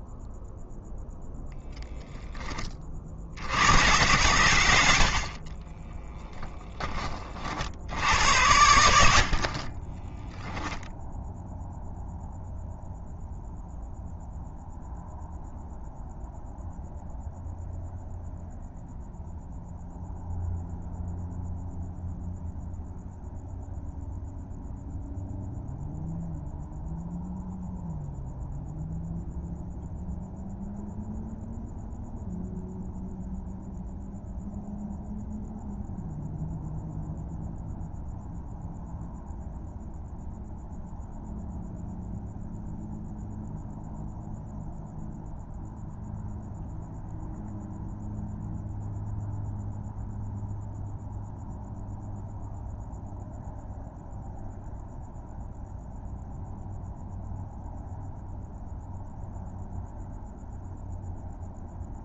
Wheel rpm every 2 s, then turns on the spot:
0, 20, 80, 10, 80, 0, 0, 0, 0, 0, 0, 0, 0, 0, 0, 0, 0, 0, 0, 0, 0, 0, 0, 0, 0, 0, 0, 0, 0, 0, 0.
none